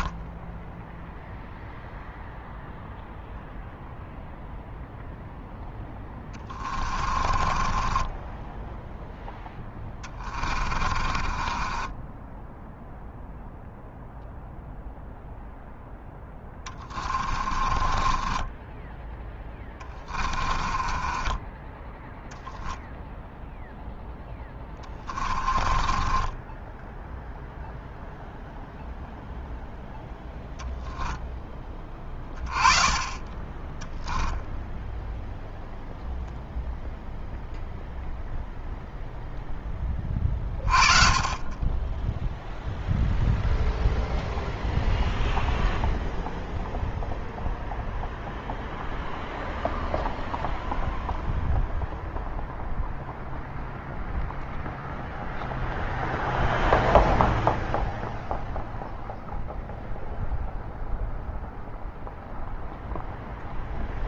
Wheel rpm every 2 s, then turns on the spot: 10, 0, 0, 30, 10, 30, 0, 0, 20, 10, 30, 10, 10, 10, 0, 0, 20, 0, 0, 0, 30, 0, 0, 0, 0, 0, 0, 0, 0, 0, 0, 0.
0-2 6-12 16-22 24-28